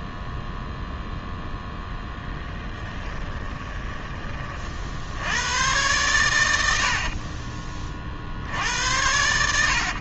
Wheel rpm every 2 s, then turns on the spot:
0, 10, 40, 80, 80.
2-4